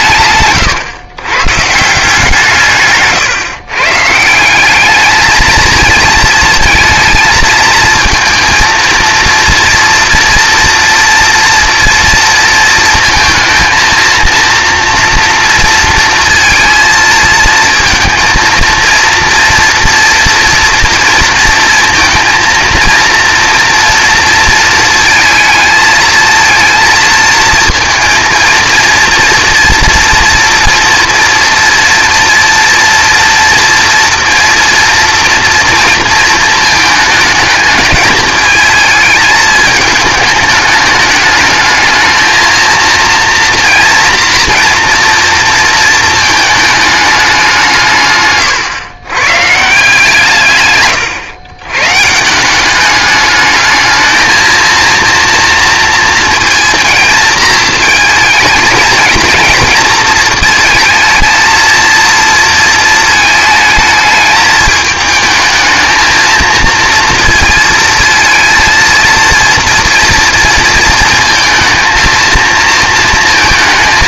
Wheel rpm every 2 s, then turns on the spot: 130, 160, 180, 230, 230, 230, 220, 230, 230, 230, 230, 230, 220, 230, 230, 230, 230, 230, 220, 220, 210, 230, 230, 220, 130, 130, 180, 220, 230, 220, 230, 230, 220, 230, 230, 230, 230.
0-2 48-50